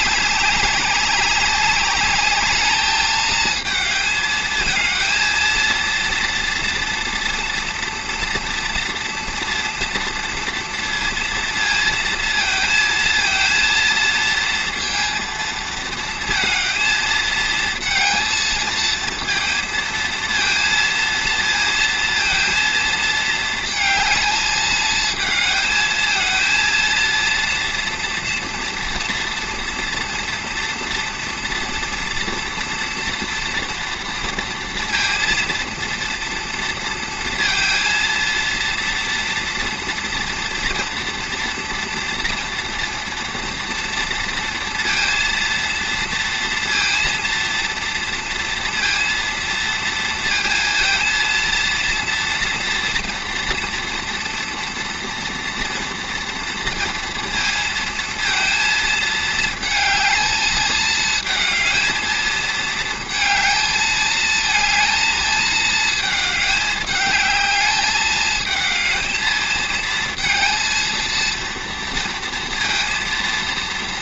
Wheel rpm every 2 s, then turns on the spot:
190, 210, 220, 230, 230, 230, 230, 230, 230, 220, 230, 230, 220, 220, 230, 230, 230, 230, 230, 230, 230, 230, 230, 230, 230, 230, 240, 230, 230, 230, 220, 220, 220, 210, 220, 230, 230.
none